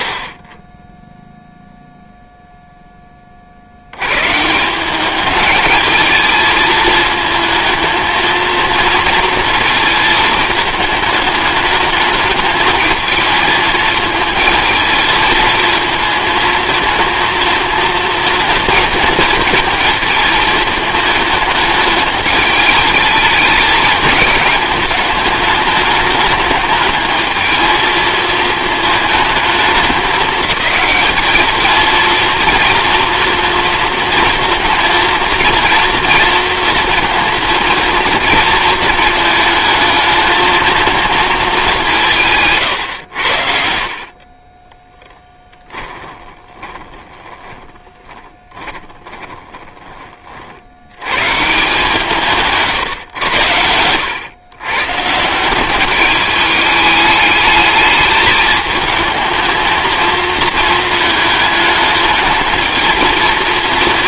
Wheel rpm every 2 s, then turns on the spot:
20, 0, 170, 220, 230, 210, 220, 230, 220, 220, 220, 210, 210, 210, 220, 210, 230, 230, 230, 230, 220, 120, 10, 20, 20, 80, 140, 120, 210, 220, 220, 230.
44-50